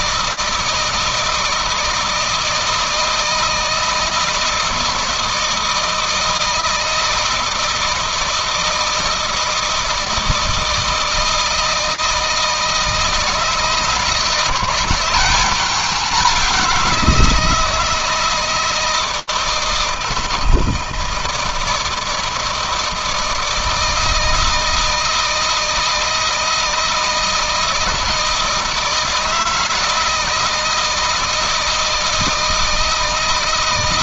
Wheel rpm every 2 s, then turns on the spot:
160, 160, 160, 160, 160, 160, 160, 170, 190, 160, 160, 160, 160, 160, 170, 160, 160.
none